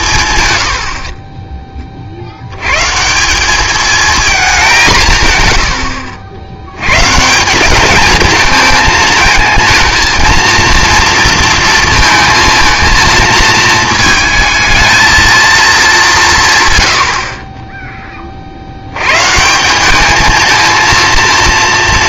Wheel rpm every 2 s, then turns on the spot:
100, 120, 200, 100, 210, 230, 230, 220, 130, 60, 220.
none